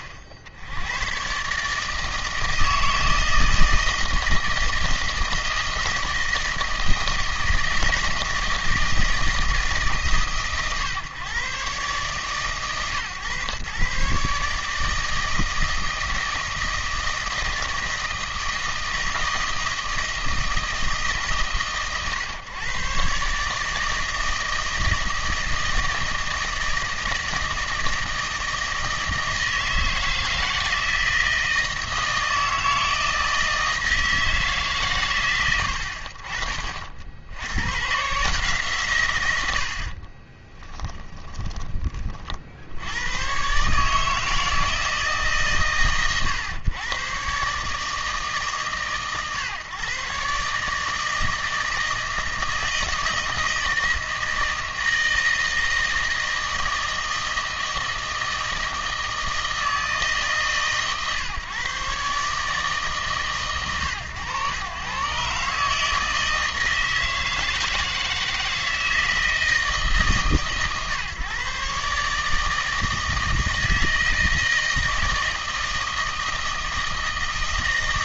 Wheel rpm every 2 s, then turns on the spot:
70, 160, 160, 160, 160, 120, 130, 150, 160, 160, 160, 120, 160, 160, 160, 170, 160, 150, 40, 140, 20, 70, 160, 110, 130, 150, 160, 160, 160, 160, 140, 150, 120, 160, 160, 140, 160, 160, 160.
40-42